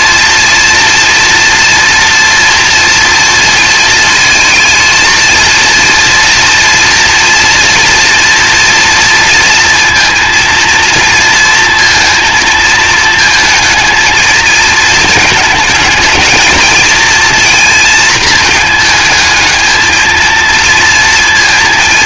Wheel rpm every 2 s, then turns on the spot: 240, 230, 230, 230, 230, 230, 220, 220, 220, 220, 230.
none